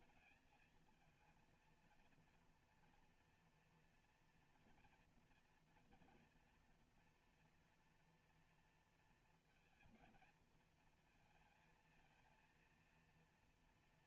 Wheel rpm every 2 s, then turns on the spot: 220, 230, 230, 240, 230, 230, 230.
none